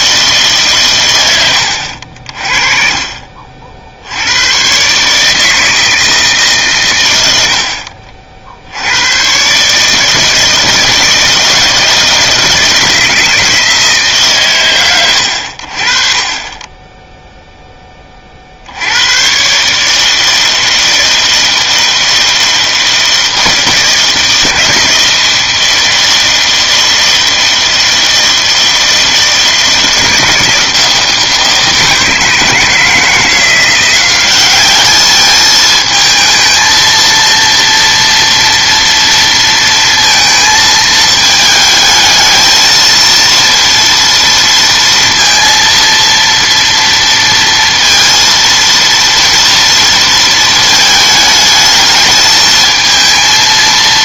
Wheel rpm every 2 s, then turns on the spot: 140, 40, 120, 130, 70, 160, 160, 120, 20, 70, 160, 160, 160, 160, 160, 160, 160, 200, 220, 230, 220, 220, 230, 230, 230, 220, 220.
none